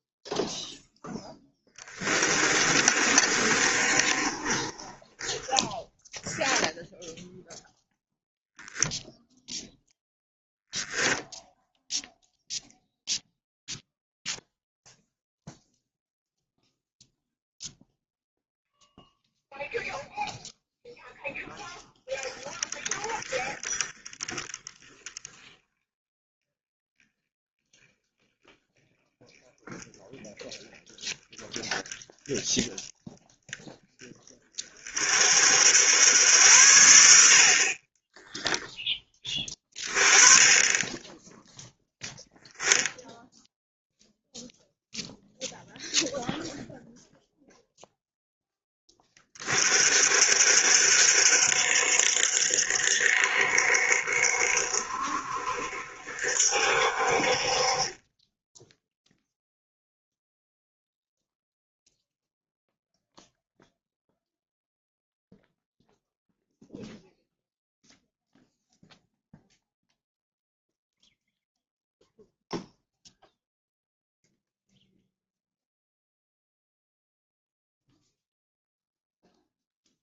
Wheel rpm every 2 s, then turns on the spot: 0, 20, 30, 10, 0, 0, 0, 0, 0, 0, 0, 20, 10, 10, 10, 10, 10, 40, 80, 10, 20, 0, 0, 0, 10, 60, 60, 60, 60, 0, 0, 0, 0, 0, 0, 0, 0, 0, 0, 0.
2-6